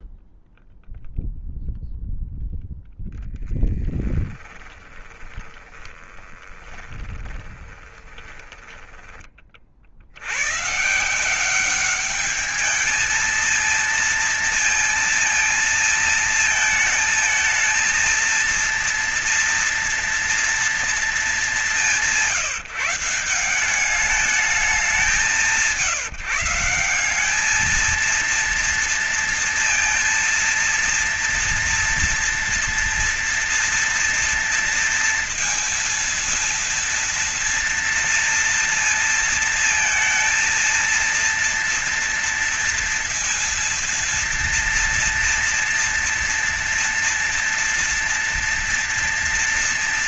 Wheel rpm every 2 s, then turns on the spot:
0, 0, 20, 20, 20, 150, 220, 230, 220, 230, 230, 170, 180, 180, 230, 230, 230, 230, 230, 230, 230, 230, 230, 230, 230.
4-8